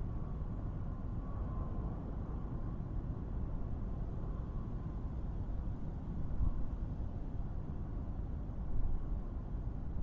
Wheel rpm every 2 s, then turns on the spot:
0, 0, 0, 0, 0.
none